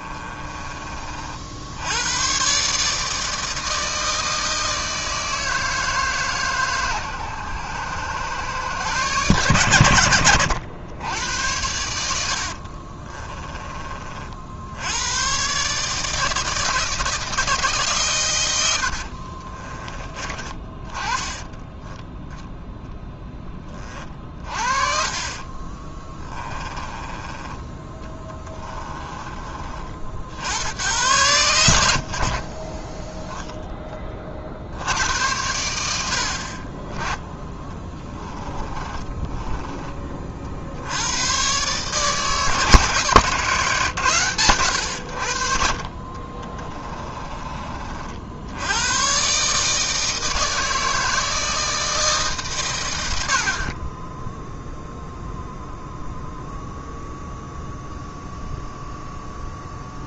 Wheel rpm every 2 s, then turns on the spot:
30, 140, 160, 130, 120, 90, 40, 80, 160, 80, 20, 0, 40, 20, 20, 100, 30, 70, 30, 20, 70, 150, 90, 20, 90, 160, 120, 0, 0, 0.
12-14 24-30 38-40 46-48